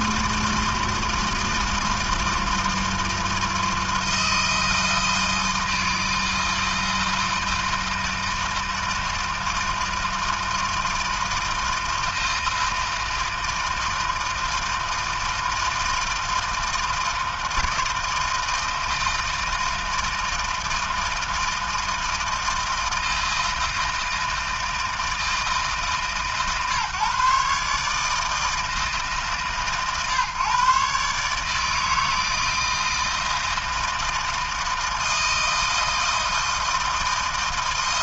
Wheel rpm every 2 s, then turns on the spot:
160, 160, 160, 160, 160, 160, 160, 160, 160, 160, 160, 160, 160, 130, 160, 130, 160, 160, 160.
none